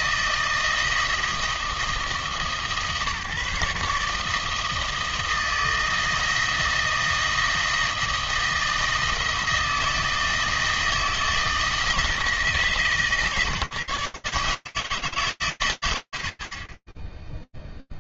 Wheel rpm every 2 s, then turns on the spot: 160, 150, 160, 160, 160, 160, 160, 160, 40.
none